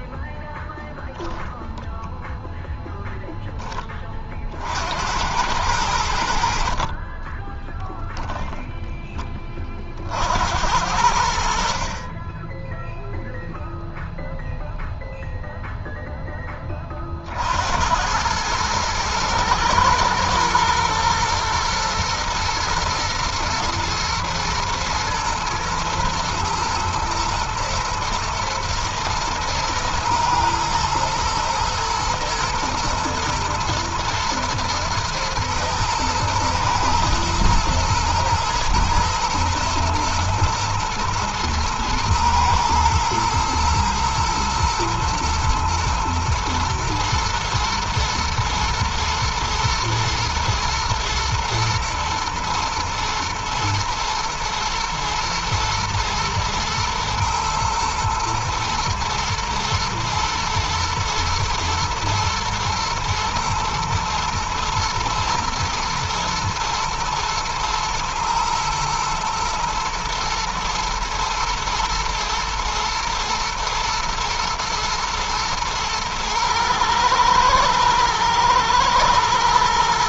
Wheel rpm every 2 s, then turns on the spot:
0, 0, 50, 60, 0, 70, 20, 0, 10, 100, 120, 110, 120, 120, 110, 110, 110, 120, 110, 110, 110, 120, 110, 120, 120, 120, 110, 110, 110, 120, 120, 110, 110, 110, 110, 110, 120, 120, 110, 110.
none